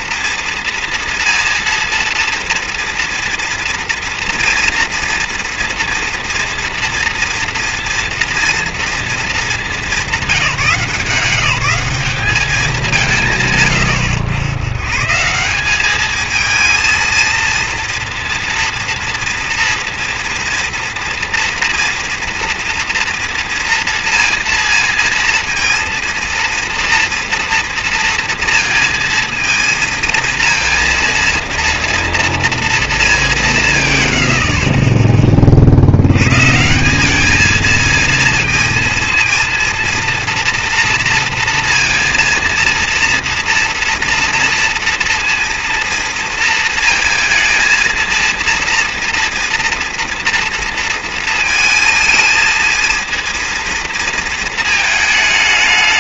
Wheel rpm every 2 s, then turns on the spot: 230, 230, 230, 240, 240, 180, 200, 100, 220, 230, 230, 230, 230, 230, 230, 230, 230, 50, 160, 230, 230, 230, 230, 230, 230, 230, 220, 220.
none